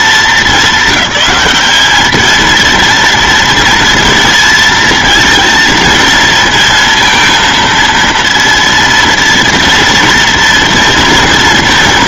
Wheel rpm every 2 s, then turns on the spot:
190, 230, 230, 230, 230, 230.
none